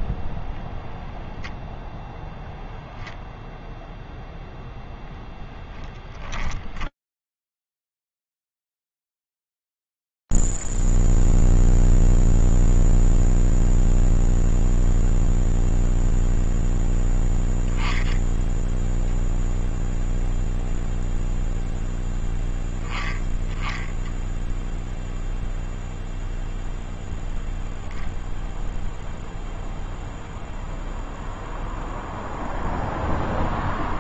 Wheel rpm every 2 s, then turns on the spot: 0, 0, 0, 10, 10, 0, 0, 0, 0, 0, 0, 0, 0, 0, 0, 0, 0.
6-8